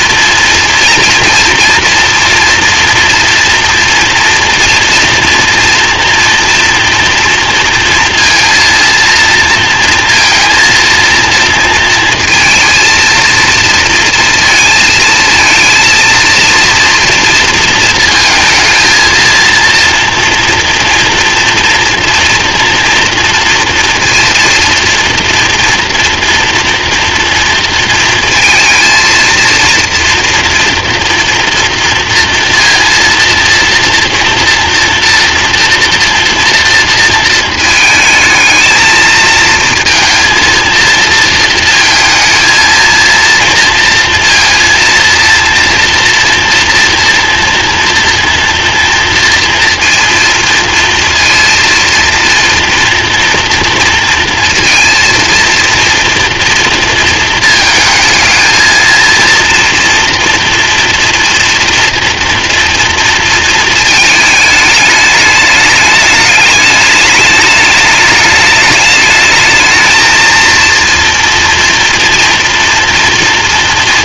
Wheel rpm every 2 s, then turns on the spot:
240, 230, 230, 230, 230, 230, 220, 230, 230, 230, 240, 230, 230, 240, 230, 230, 230, 230, 230, 220, 230, 230, 230, 230, 230, 230, 230, 230, 230, 220, 230, 230, 210, 210, 210, 230, 240.
none